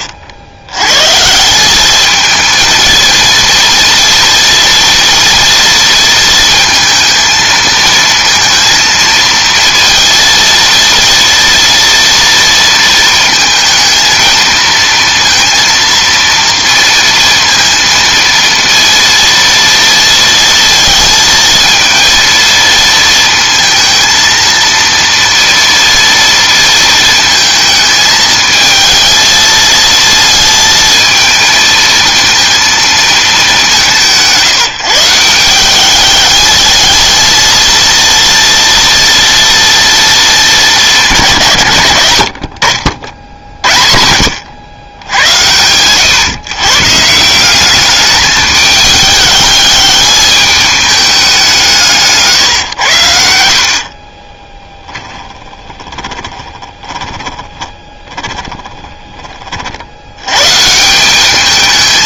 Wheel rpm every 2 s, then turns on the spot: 100, 220, 230, 230, 230, 230, 230, 230, 230, 230, 230, 230, 230, 230, 220, 230, 230, 160, 220, 230, 210, 60, 90, 140, 210, 210, 110, 10, 20, 10, 150.
54-60